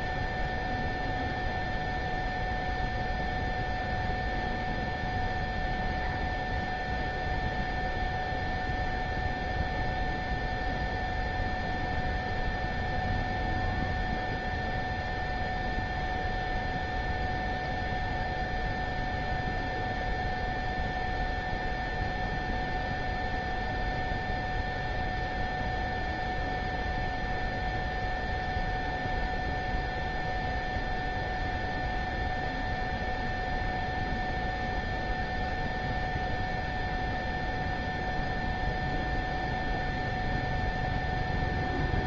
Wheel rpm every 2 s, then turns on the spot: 0, 0, 0, 0, 0, 0, 0, 0, 0, 0, 0, 0, 0, 0, 0, 0, 0, 0, 0, 0, 0.
none